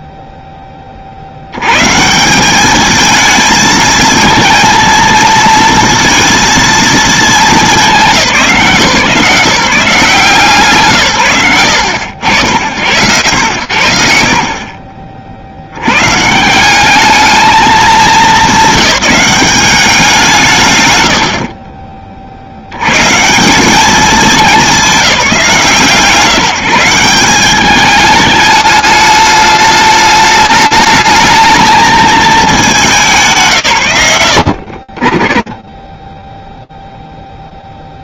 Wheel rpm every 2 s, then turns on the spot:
0, 180, 230, 230, 190, 170, 80, 40, 160, 190, 140, 80, 190, 180, 210, 210, 190, 20, 20.
none